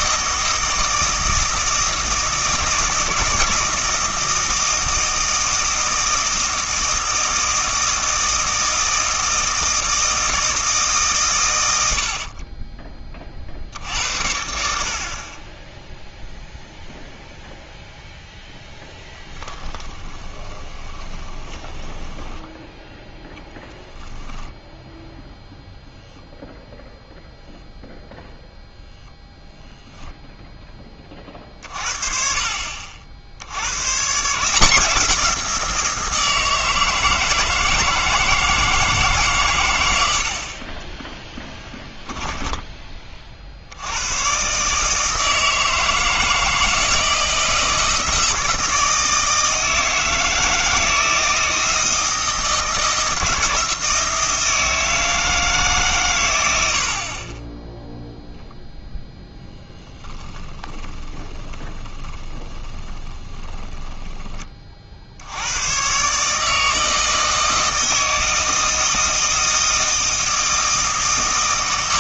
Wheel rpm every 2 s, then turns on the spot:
160, 160, 160, 160, 160, 160, 30, 60, 0, 10, 20, 10, 10, 0, 0, 20, 50, 170, 160, 160, 20, 10, 140, 160, 160, 160, 160, 160, 80, 0, 20, 20, 30, 160, 160, 160.
18-22 60-64